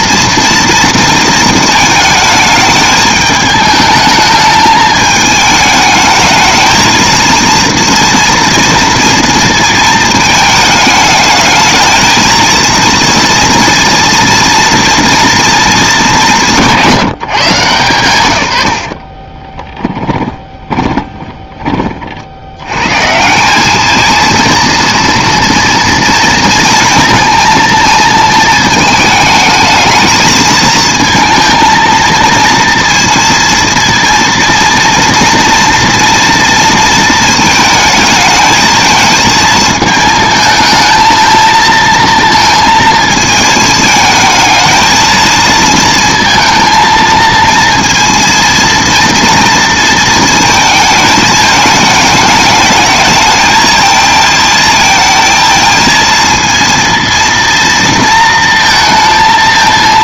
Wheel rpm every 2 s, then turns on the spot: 230, 220, 210, 220, 230, 220, 230, 230, 150, 70, 20, 100, 230, 230, 220, 230, 230, 230, 230, 220, 220, 230, 220, 230, 230, 220, 220, 220, 230, 230.
18-22